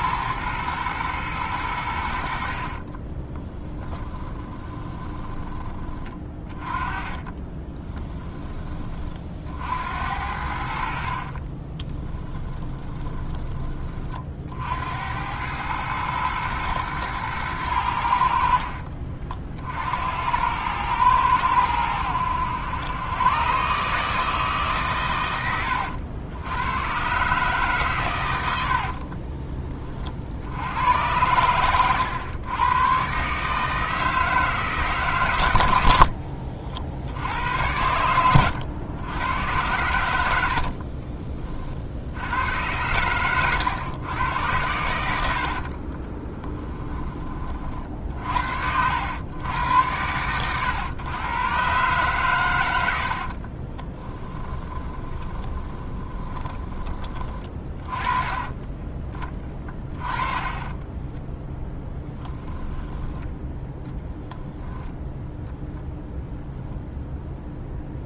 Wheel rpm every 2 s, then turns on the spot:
110, 40, 20, 30, 30, 60, 20, 70, 110, 50, 100, 100, 140, 110, 90, 80, 110, 150, 60, 100, 60, 100, 100, 20, 70, 110, 90, 20, 20, 30, 10, 10, 10, 0.
2-8 10-14 28-30 40-42 46-48 54-58 60-62